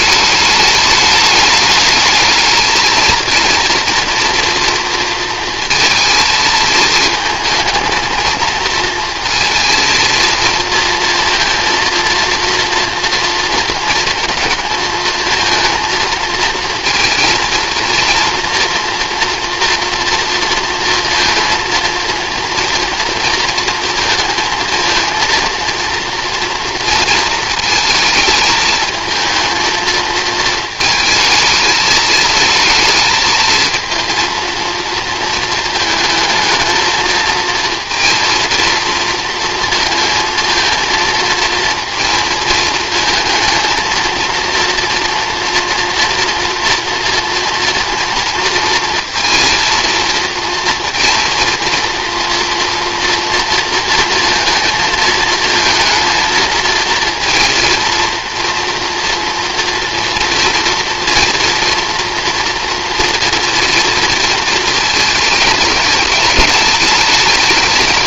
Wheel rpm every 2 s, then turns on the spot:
210, 230, 230, 220, 230, 230, 230, 230, 230, 230, 230, 230, 230, 230, 220, 220, 220, 220, 220, 230, 230, 220, 230, 230, 230, 230, 230, 220, 230, 230, 230, 240, 220, 210.
none